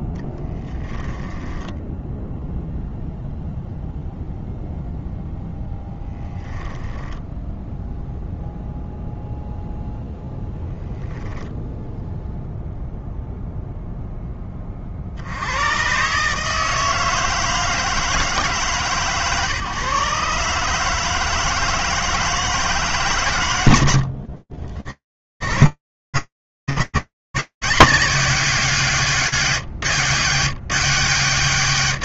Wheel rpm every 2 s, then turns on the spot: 10, 0, 0, 10, 0, 0, 0, 40, 160, 140, 150, 130, 130, 130, 130, 0.
0-2